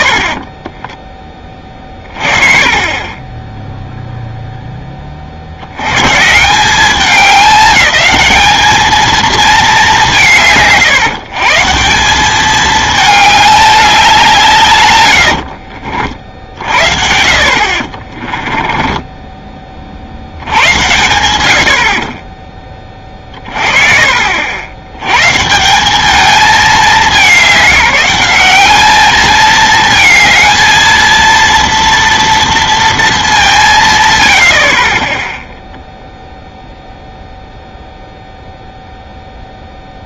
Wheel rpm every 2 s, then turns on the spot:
50, 40, 10, 180, 220, 150, 210, 150, 50, 20, 90, 10, 70, 210, 200, 220, 230, 40, 0, 0.
18-20